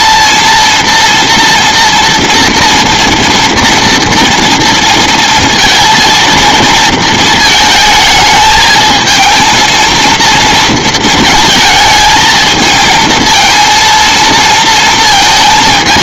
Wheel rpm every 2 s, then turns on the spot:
230, 230, 230, 230, 220, 220, 220, 220.
none